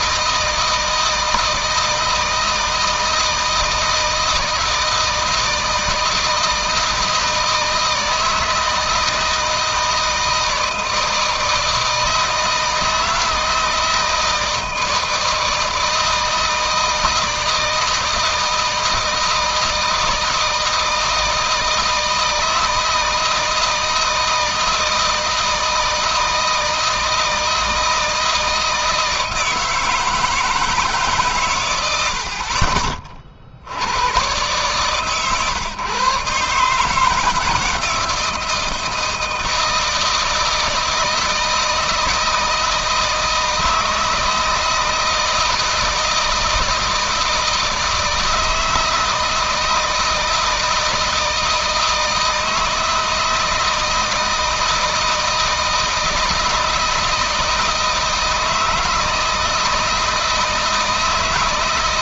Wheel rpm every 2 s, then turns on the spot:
160, 160, 160, 160, 160, 160, 160, 160, 160, 160, 160, 160, 160, 160, 160, 160, 50, 130, 150, 160, 160, 160, 160, 160, 160, 160, 160, 160, 160, 160, 160.
none